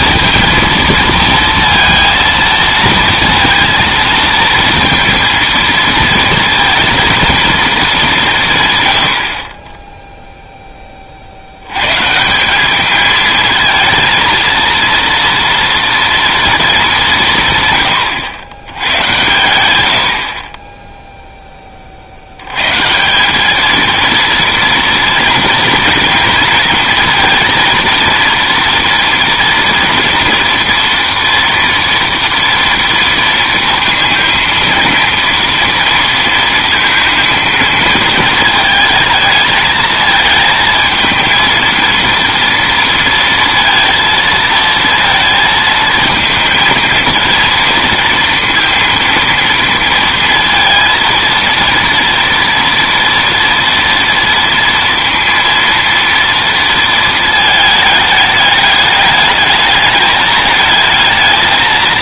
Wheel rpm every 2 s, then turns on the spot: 230, 230, 230, 230, 140, 10, 190, 230, 220, 100, 30, 110, 230, 230, 230, 230, 230, 230, 230, 220, 220, 230, 220, 230, 230, 230, 230, 230, 230, 210, 220.
none